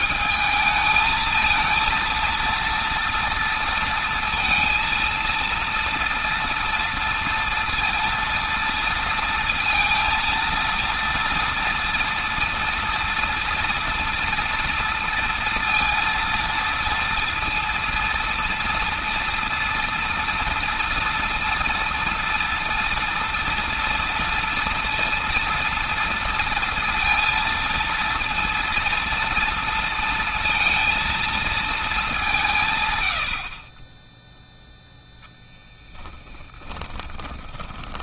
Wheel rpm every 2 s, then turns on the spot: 220, 230, 230, 230, 230, 230, 230, 240, 230, 230, 230, 230, 230, 230, 230, 230, 130, 0, 10.
36-38